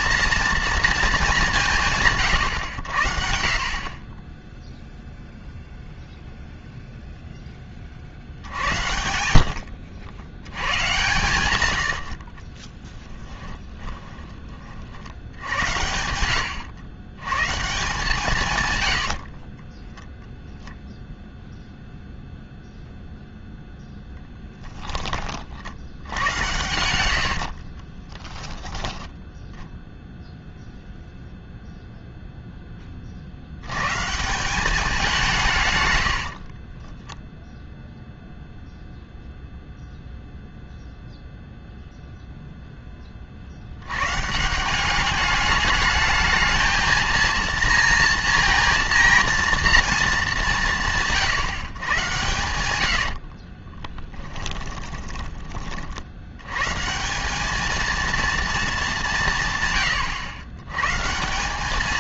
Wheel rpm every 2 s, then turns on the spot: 230, 110, 10, 0, 80, 90, 30, 40, 90, 130, 0, 0, 10, 100, 10, 0, 10, 180, 40, 0, 0, 0, 170, 220, 230, 180, 100, 10, 120, 220, 110.
8-10 12-14 18-20 26-28 36-38 54-56